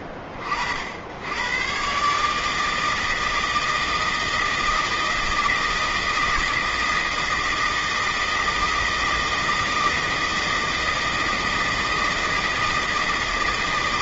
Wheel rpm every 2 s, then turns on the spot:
70, 160, 160, 160, 160, 160, 160.
none